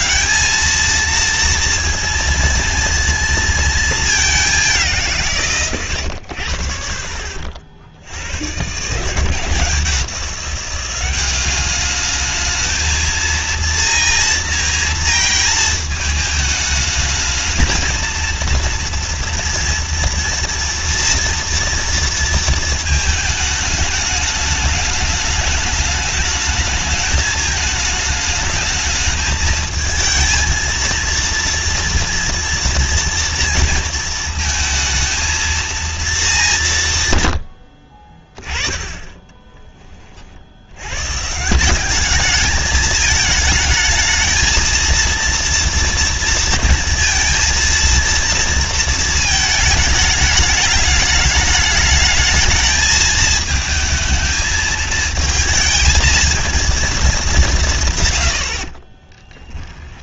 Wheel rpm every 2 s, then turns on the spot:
230, 230, 180, 50, 150, 190, 220, 230, 220, 230, 240, 220, 210, 210, 220, 230, 230, 230, 130, 10, 150, 220, 230, 230, 220, 210, 220, 220, 210, 30.
58-60